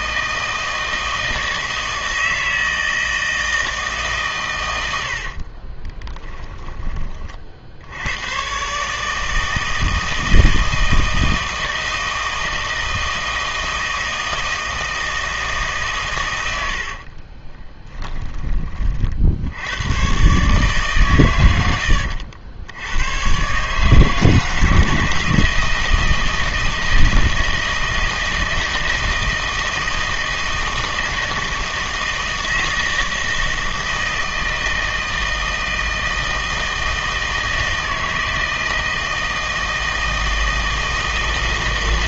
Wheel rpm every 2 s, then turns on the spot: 160, 160, 100, 10, 140, 160, 160, 160, 70, 30, 140, 90, 160, 160, 160, 160, 160, 160, 160, 160, 160.
16-18